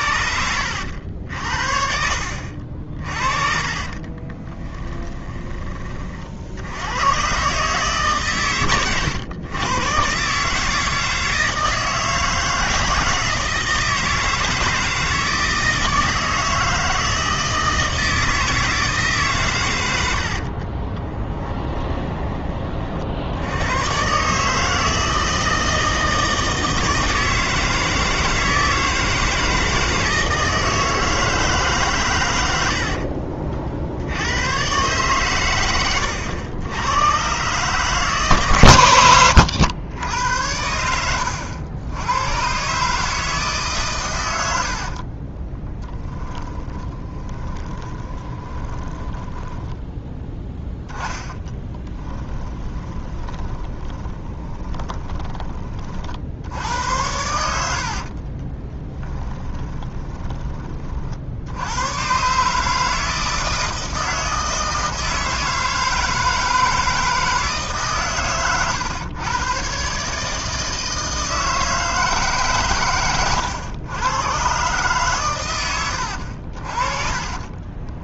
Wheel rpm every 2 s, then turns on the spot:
70, 50, 20, 90, 110, 150, 160, 160, 160, 160, 30, 40, 160, 160, 160, 160, 70, 120, 100, 110, 90, 140, 60, 20, 10, 10, 20, 20, 90, 20, 30, 150, 160, 160, 120, 160, 130, 130, 50.
4-6 20-22 32-34 40-42 46-56 58-60